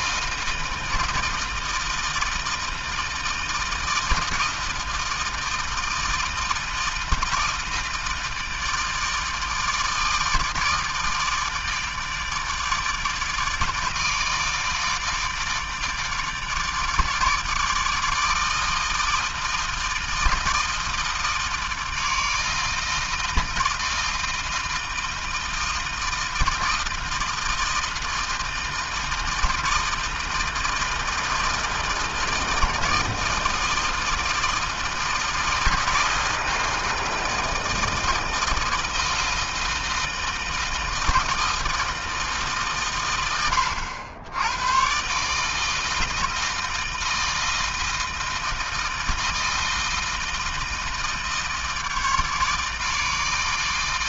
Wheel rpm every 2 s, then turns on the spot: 160, 160, 160, 160, 160, 160, 150, 160, 150, 160, 160, 160, 160, 160, 160, 160, 160, 160, 160, 160, 160, 110, 140, 160, 160, 160, 160.
none